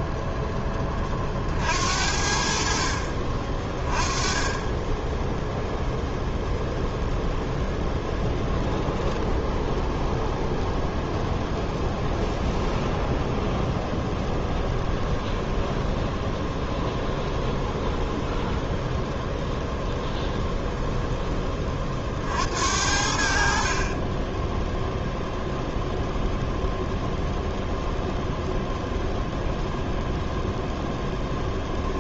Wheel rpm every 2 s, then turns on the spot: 10, 60, 10, 0, 10, 0, 10, 10, 10, 0, 0, 70, 0, 0, 0, 0.
8-10